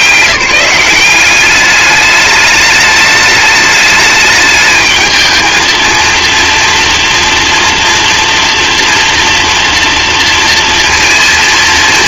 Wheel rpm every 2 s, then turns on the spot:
180, 210, 210, 230, 230, 230.
none